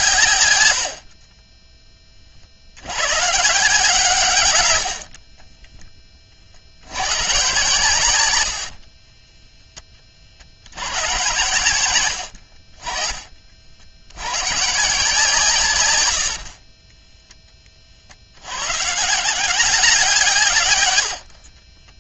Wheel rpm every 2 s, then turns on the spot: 60, 100, 70, 100, 40, 100, 40, 150, 20, 150, 90.
4-6 8-10 16-18 20-22